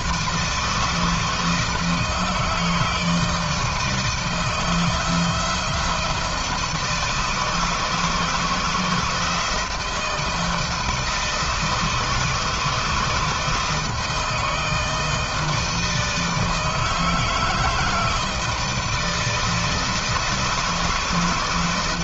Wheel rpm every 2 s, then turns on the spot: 160, 160, 170, 160, 160, 160, 160, 160, 160, 160, 160.
none